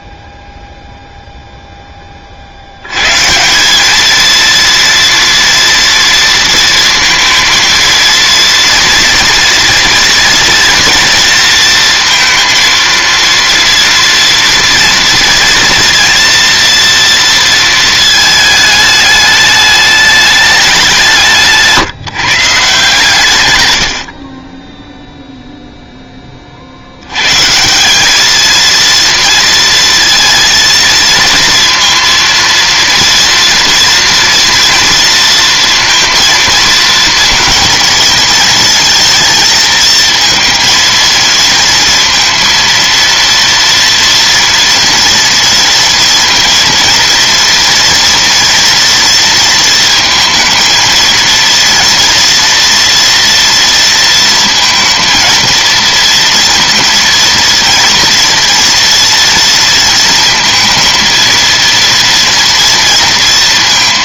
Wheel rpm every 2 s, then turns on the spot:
0, 90, 230, 230, 240, 230, 230, 230, 230, 210, 180, 150, 10, 70, 230, 230, 230, 230, 220, 230, 230, 230, 230, 230, 230, 230, 230, 230, 230, 230, 230, 230.
none